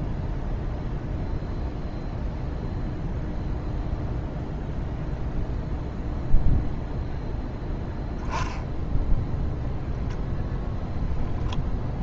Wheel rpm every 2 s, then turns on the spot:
0, 0, 0, 0, 0, 0.
none